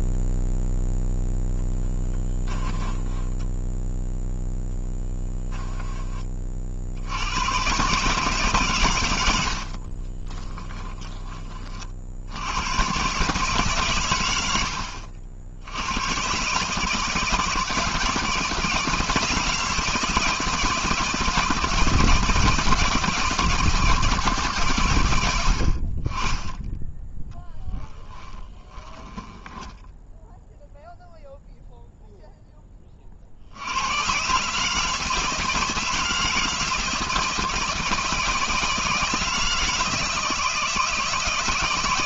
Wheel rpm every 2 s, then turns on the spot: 0, 10, 0, 60, 120, 10, 110, 80, 140, 160, 160, 160, 140, 10, 10, 0, 20, 150, 160, 160, 160.
2-4 10-12 28-30